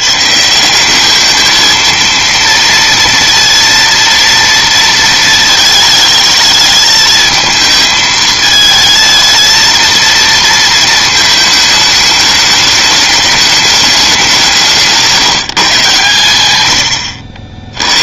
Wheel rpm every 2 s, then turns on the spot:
170, 230, 230, 220, 220, 230, 210, 170, 100.
none